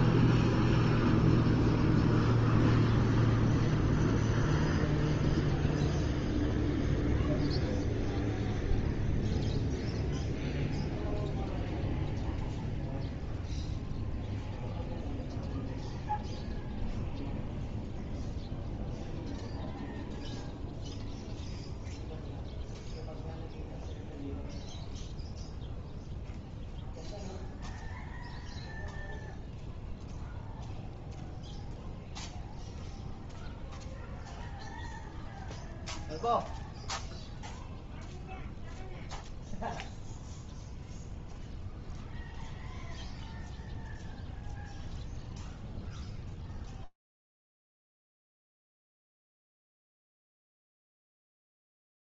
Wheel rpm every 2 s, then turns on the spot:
0, 0, 0, 0, 0, 0, 0, 0, 0, 0, 0, 0, 0, 0, 0, 0, 0, 0, 0, 0, 0, 0, 0, 0, 0, 0.
none